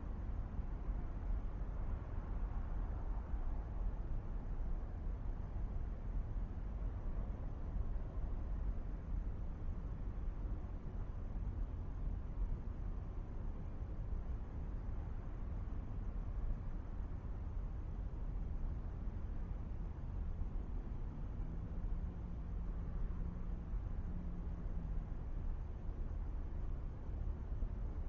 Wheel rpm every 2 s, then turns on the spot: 0, 0, 0, 0, 0, 0, 0, 0, 0, 0, 0, 0, 0, 0.
none